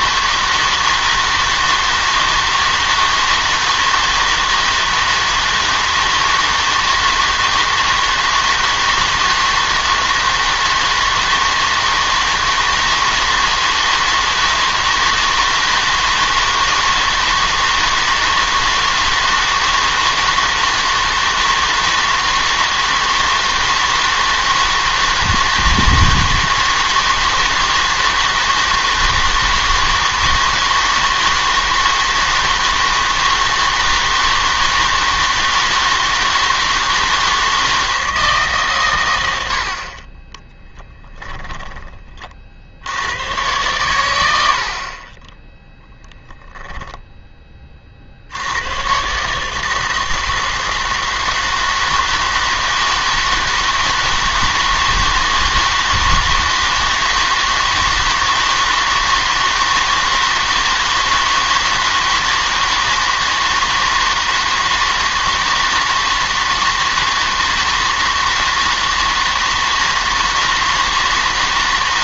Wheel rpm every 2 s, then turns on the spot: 160, 160, 160, 160, 160, 160, 160, 160, 160, 160, 160, 160, 160, 160, 160, 160, 160, 160, 160, 130, 10, 70, 60, 20, 100, 160, 160, 160, 160, 160, 160, 160, 160, 160, 160, 160.
40-42 44-48